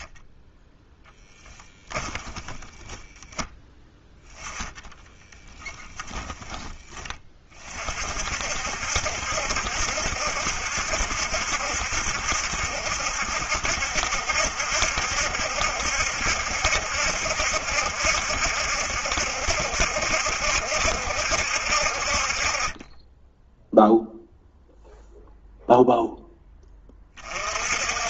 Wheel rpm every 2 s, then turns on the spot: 10, 10, 20, 30, 70, 70, 70, 70, 70, 70, 60, 10, 0, 30.
0-2 4-6